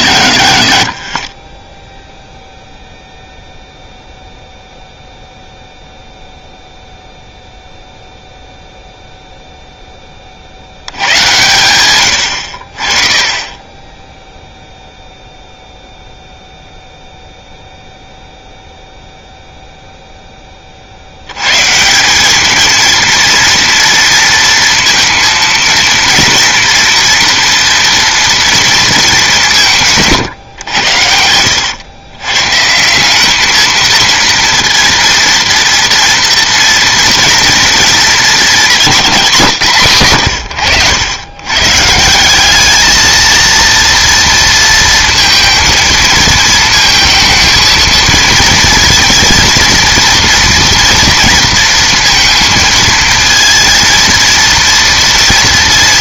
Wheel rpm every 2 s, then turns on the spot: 70, 0, 0, 0, 0, 80, 60, 0, 0, 0, 30, 220, 230, 230, 230, 110, 140, 230, 230, 220, 100, 210, 230, 230, 230, 240, 230, 230.
40-42